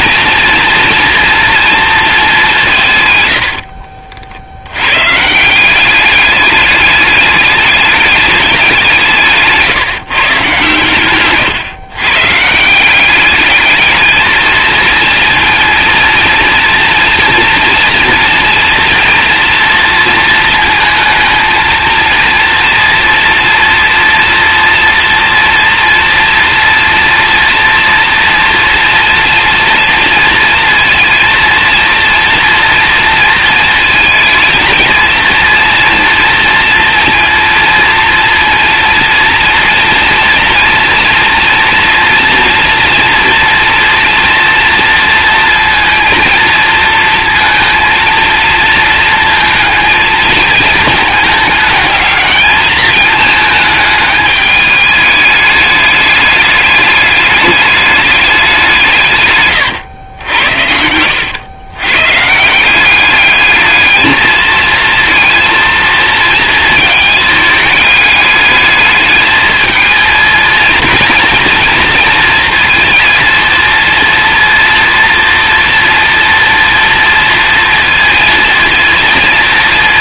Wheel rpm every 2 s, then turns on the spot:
240, 150, 100, 210, 190, 130, 180, 230, 230, 230, 230, 230, 230, 230, 230, 230, 240, 230, 230, 230, 230, 230, 230, 230, 230, 220, 220, 210, 210, 180, 80, 180, 220, 220, 210, 230, 230, 230, 240, 230.
60-62